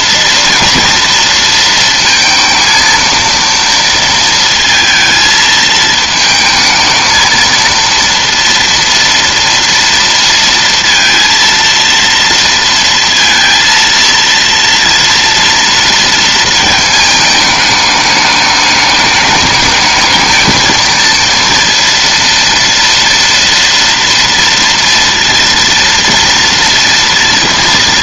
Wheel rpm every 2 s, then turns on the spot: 240, 230, 230, 220, 230, 230, 230, 230, 220, 210, 230, 230, 230, 230.
none